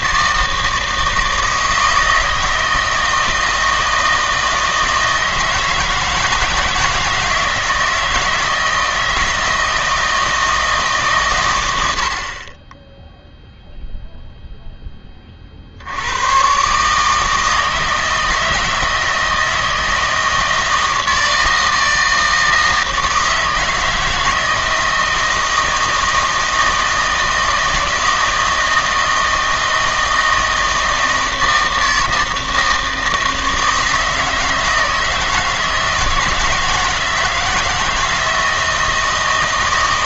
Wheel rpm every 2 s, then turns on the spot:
160, 160, 160, 160, 160, 160, 20, 0, 130, 160, 160, 160, 160, 160, 160, 160, 160, 160, 160, 160.
none